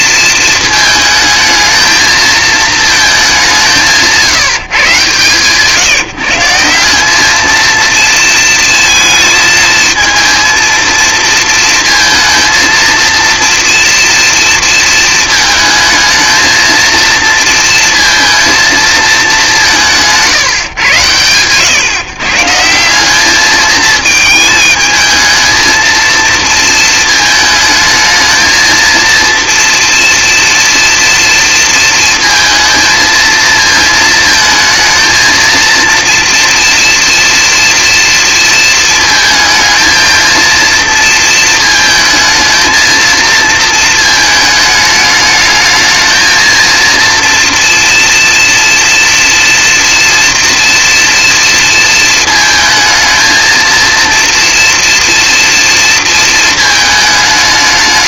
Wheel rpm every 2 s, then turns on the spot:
220, 230, 150, 190, 220, 230, 230, 230, 230, 230, 120, 180, 220, 220, 230, 230, 230, 220, 230, 230, 230, 230, 210, 230, 230, 230, 220, 230, 220.
none